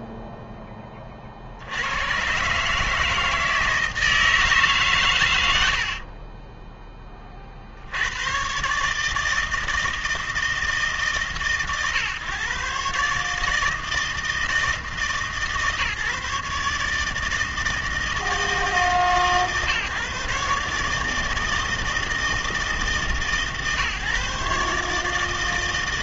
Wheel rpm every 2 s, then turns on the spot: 10, 140, 140, 20, 140, 150, 140, 160, 150, 160, 150, 150, 140.
none